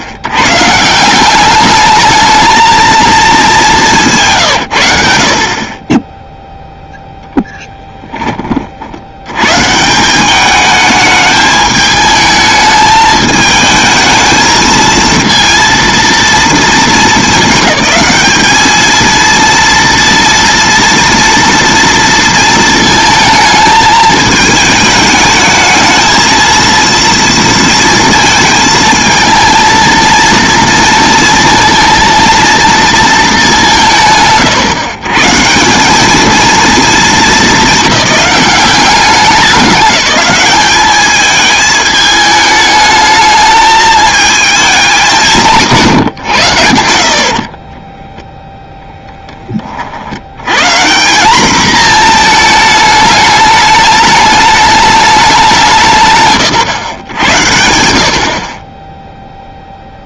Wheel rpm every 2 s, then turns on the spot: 130, 220, 130, 0, 40, 210, 220, 220, 220, 220, 230, 230, 220, 230, 230, 230, 230, 130, 210, 190, 210, 210, 210, 80, 0, 150, 220, 210, 110, 30.
none